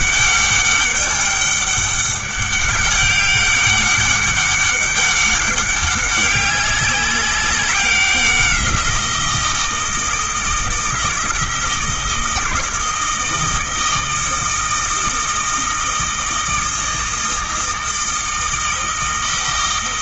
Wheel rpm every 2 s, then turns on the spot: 200, 200, 200, 200, 180, 160, 160, 160, 160, 160.
none